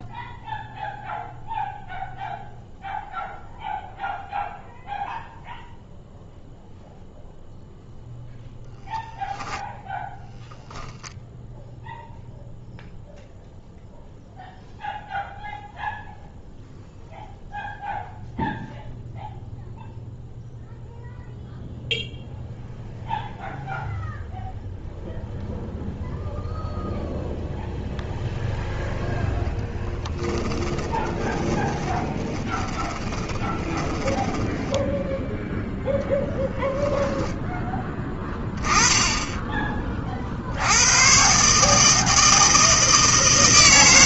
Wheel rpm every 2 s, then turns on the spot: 0, 0, 0, 0, 0, 0, 0, 0, 0, 0, 0, 0, 0, 0, 0, 20, 30, 10, 0, 20, 70, 160.
30-36